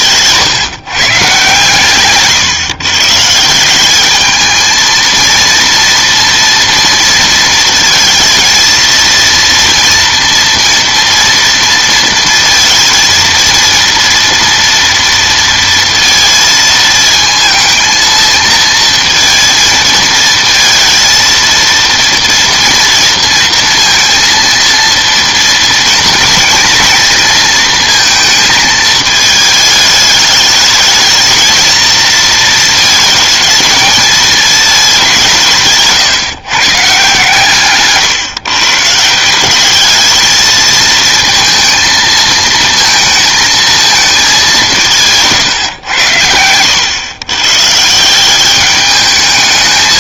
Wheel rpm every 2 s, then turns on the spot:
140, 130, 220, 230, 230, 230, 230, 230, 230, 230, 230, 230, 230, 230, 220, 220, 230, 210, 130, 140, 220, 230, 180, 100, 200.
none